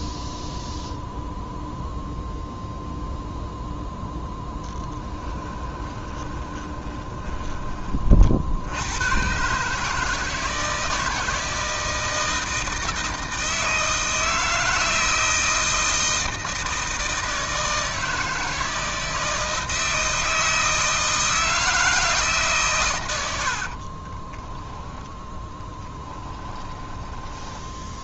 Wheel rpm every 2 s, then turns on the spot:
0, 0, 10, 20, 90, 160, 160, 160, 160, 160, 160, 120, 20, 20.
4-8 24-28